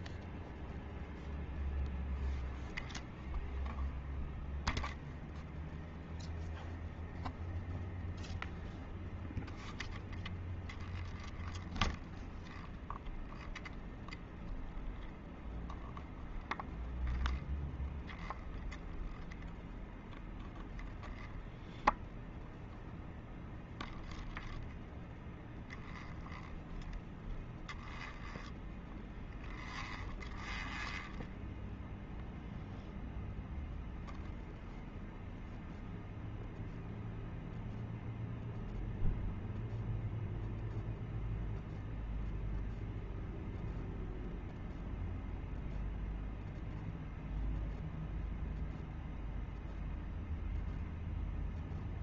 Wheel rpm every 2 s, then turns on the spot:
0, 0, 0, 0, 0, 0, 0, 0, 0, 0, 0, 0, 0, 0, 0, 0, 0, 0, 0, 0, 0, 0, 0, 0, 0, 0.
none